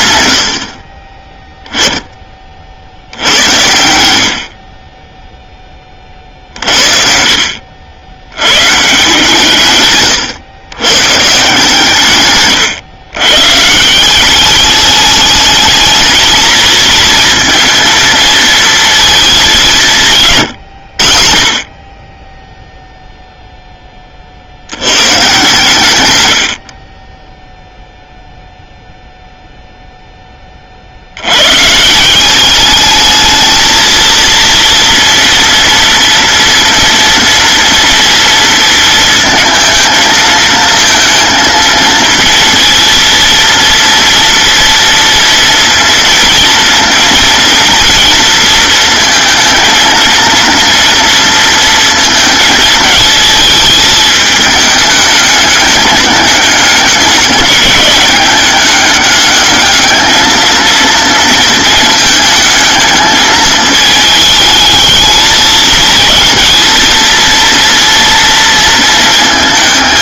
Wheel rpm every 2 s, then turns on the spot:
70, 50, 30, 50, 140, 130, 120, 210, 230, 220, 60, 0, 130, 20, 0, 80, 210, 230, 230, 230, 230, 230, 230, 230, 230, 230, 220, 210, 200, 200, 230, 220, 220, 230, 230.
none